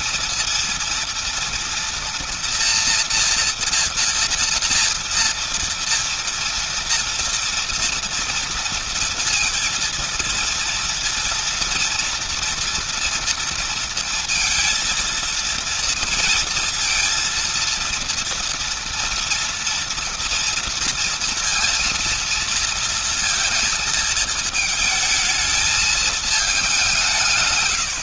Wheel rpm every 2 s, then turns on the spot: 230, 240, 230, 230, 230, 230, 230, 230, 230, 230, 230, 230, 220, 190.
none